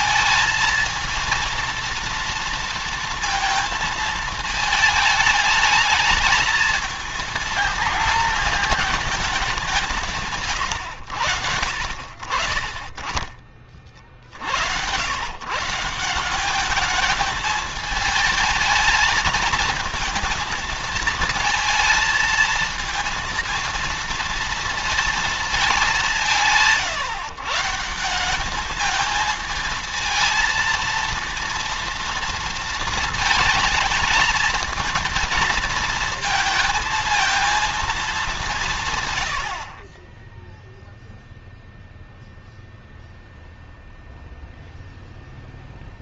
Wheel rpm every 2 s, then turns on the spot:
230, 230, 220, 230, 220, 110, 40, 90, 210, 220, 220, 230, 230, 150, 210, 230, 230, 230, 230, 150, 0, 0, 0.
none